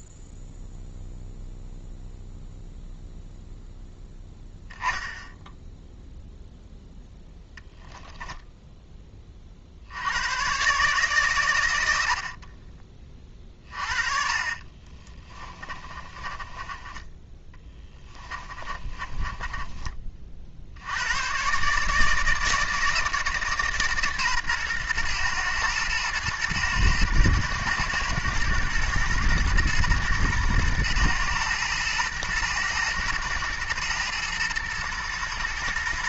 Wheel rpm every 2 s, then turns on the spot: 0, 0, 0, 0, 0, 130, 30, 30, 20, 30, 70, 160, 120, 110, 110, 110, 110, 110.
14-20